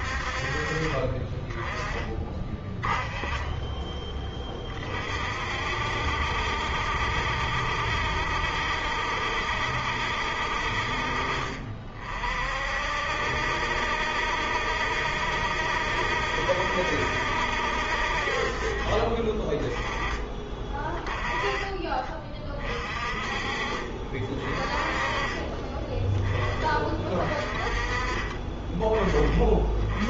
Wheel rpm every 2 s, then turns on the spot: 30, 30, 40, 70, 70, 50, 60, 70, 70, 30, 20, 30, 30, 20, 20.
24-26